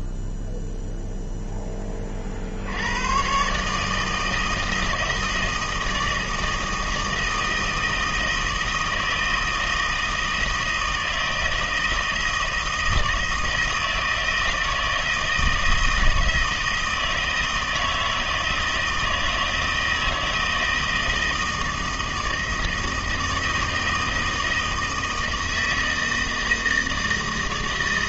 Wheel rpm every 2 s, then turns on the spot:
0, 80, 160, 160, 160, 160, 160, 160, 160, 160, 160, 160, 160, 160.
none